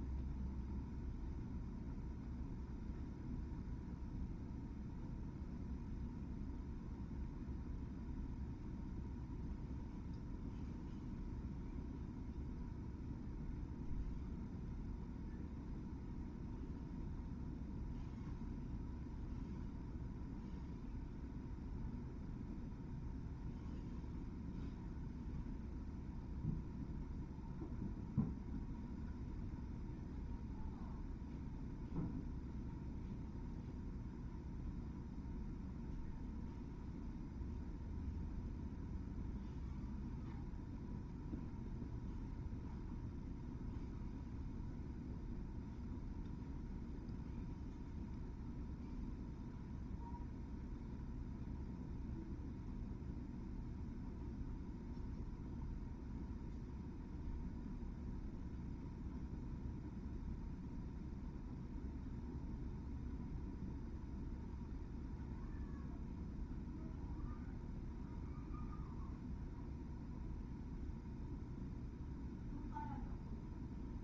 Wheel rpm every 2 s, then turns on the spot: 0, 0, 0, 0, 0, 0, 0, 0, 0, 0, 0, 0, 0, 0, 0, 0, 0, 0, 0, 0, 0, 0, 0, 0, 0, 0, 0, 0, 0, 0, 0, 0, 0, 0, 0, 0, 0.
none